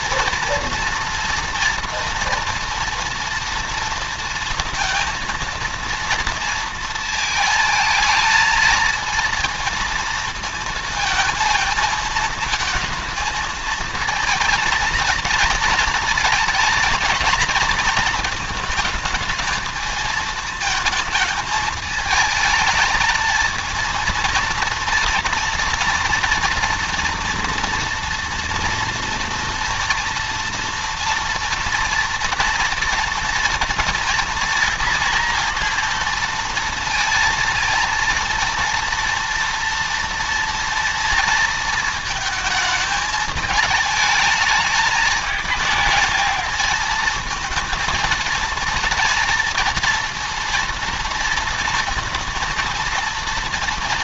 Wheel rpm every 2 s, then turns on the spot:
230, 240, 230, 230, 230, 230, 220, 230, 230, 220, 220, 220, 230, 230, 230, 230, 230, 230, 230, 230, 230, 220, 220, 220, 220, 230, 230.
none